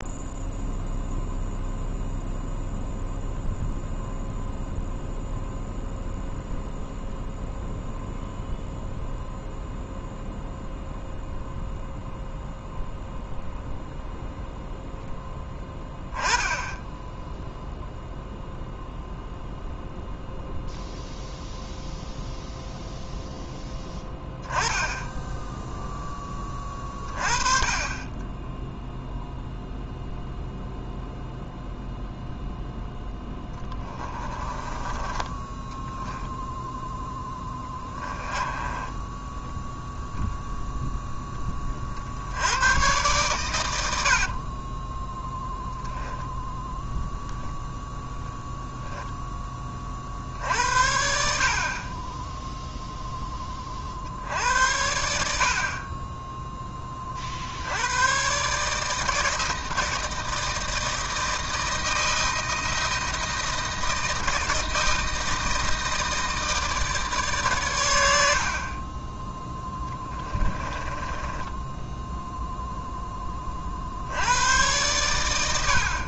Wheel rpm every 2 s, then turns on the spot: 0, 0, 0, 0, 0, 0, 0, 0, 0, 0, 0, 0, 10, 30, 0, 0, 10, 20, 10, 10, 10, 120, 10, 0, 0, 70, 10, 70, 30, 160, 160, 160, 160, 150, 20, 20, 10, 110.
34-40 44-46 68-72